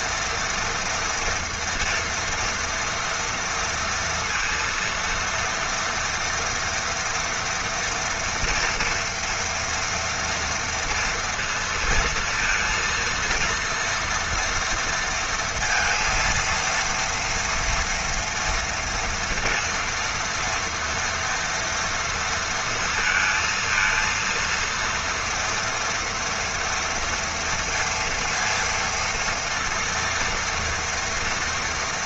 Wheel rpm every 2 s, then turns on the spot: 230, 230, 230, 230, 230, 230, 230, 230, 230, 230, 230, 220, 230, 230, 230, 230.
none